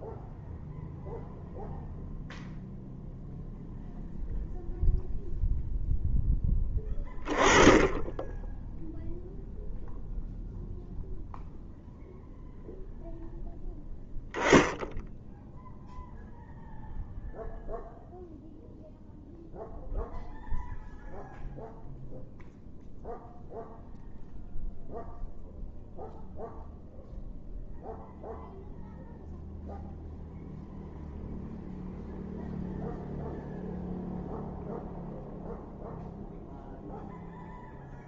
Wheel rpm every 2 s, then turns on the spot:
0, 0, 0, 20, 0, 0, 0, 0, 0, 0, 0, 0, 0, 0, 0, 0, 0, 0, 0.
none